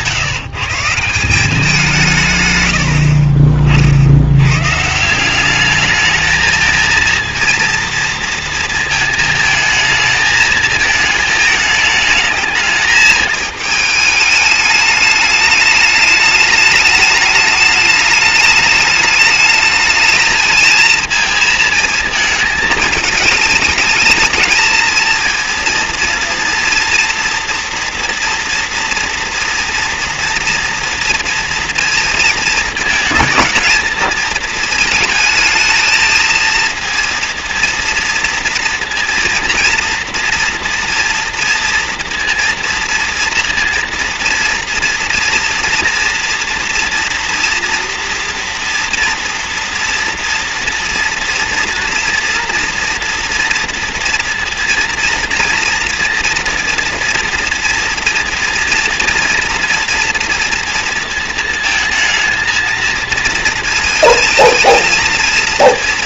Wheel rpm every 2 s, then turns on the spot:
160, 110, 130, 220, 230, 220, 220, 210, 220, 210, 230, 220, 220, 230, 230, 230, 220, 220, 230, 230, 240, 230, 230, 230, 230, 230, 230, 230, 230, 230, 230, 230, 220.
none